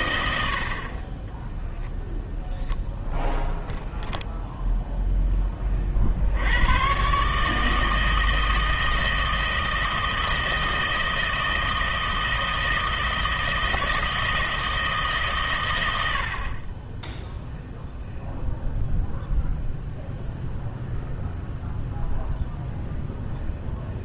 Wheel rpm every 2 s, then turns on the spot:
60, 10, 0, 100, 160, 160, 160, 160, 30, 0, 0, 0.
none